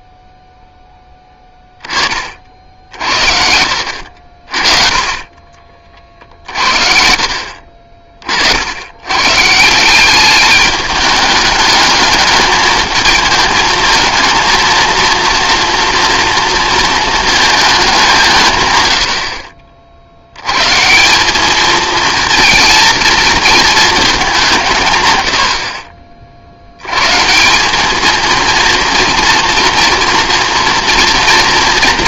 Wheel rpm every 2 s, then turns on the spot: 10, 60, 30, 60, 90, 210, 220, 230, 230, 110, 140, 220, 150, 100, 230, 230.
none